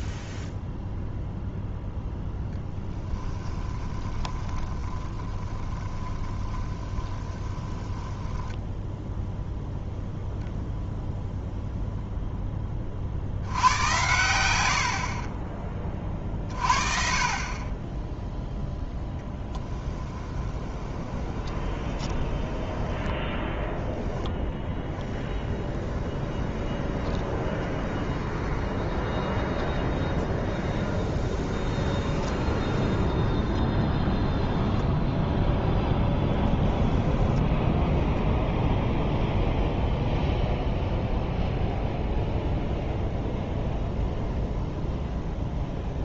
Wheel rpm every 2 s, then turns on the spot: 0, 10, 20, 20, 10, 0, 10, 90, 40, 0, 20, 20, 0, 20, 20, 20, 10, 0, 10, 0, 0, 0, 0.
2-10 20-24 26-32 36-38